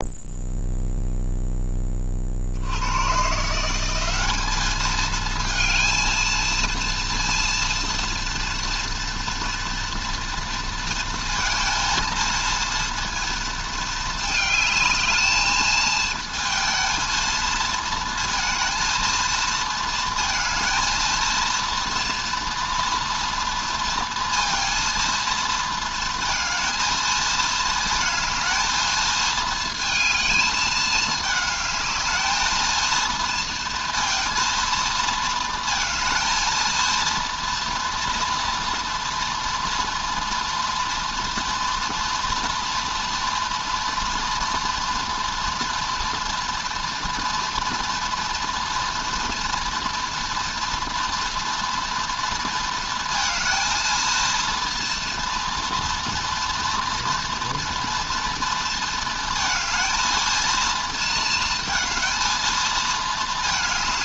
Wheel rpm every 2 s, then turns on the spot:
0, 80, 210, 230, 230, 230, 230, 220, 230, 230, 220, 230, 230, 230, 220, 210, 220, 230, 230, 230, 230, 230, 230, 230, 230, 230, 230, 230, 240, 230, 230, 220.
none